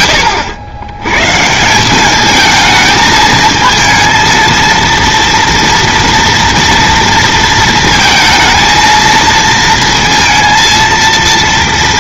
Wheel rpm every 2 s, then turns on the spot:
100, 220, 230, 230, 230, 230.
none